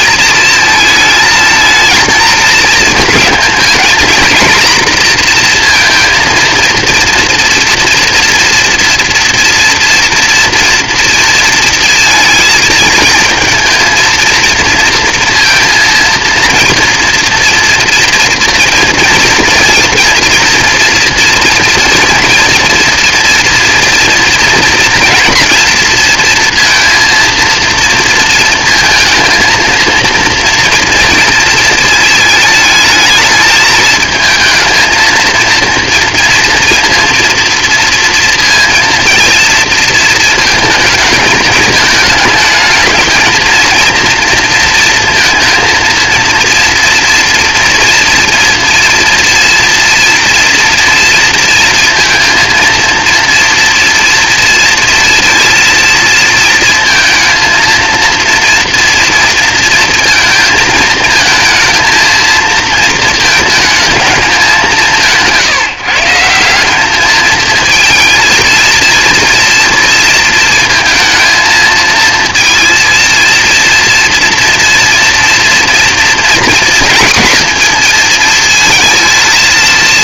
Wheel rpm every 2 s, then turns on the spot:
220, 230, 240, 230, 240, 230, 230, 230, 230, 230, 230, 230, 230, 230, 230, 230, 220, 230, 230, 230, 220, 230, 230, 230, 230, 230, 230, 230, 220, 230, 230, 220, 160, 210, 230, 230, 230, 230, 240, 220.
none